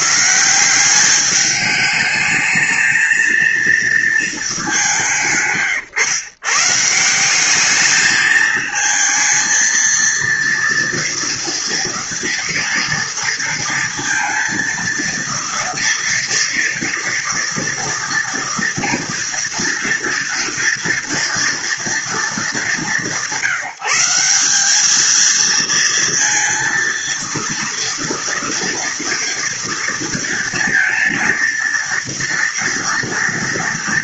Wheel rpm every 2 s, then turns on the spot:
190, 220, 190, 150, 220, 230, 230, 230, 230, 230, 230, 190, 210, 230, 230, 230, 230.
none